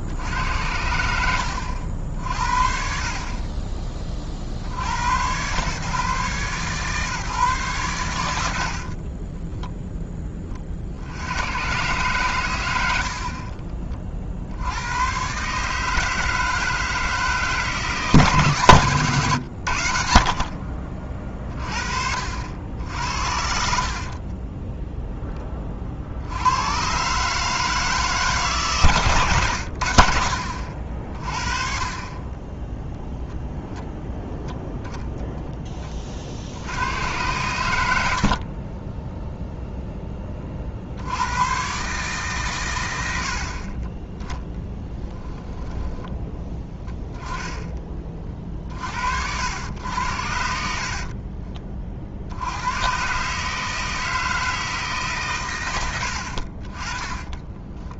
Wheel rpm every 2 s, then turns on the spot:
50, 70, 20, 140, 80, 30, 110, 90, 160, 140, 50, 60, 10, 90, 150, 50, 0, 0, 80, 50, 70, 110, 10, 10, 50, 50, 100, 160, 40.
8-10 24-26 50-52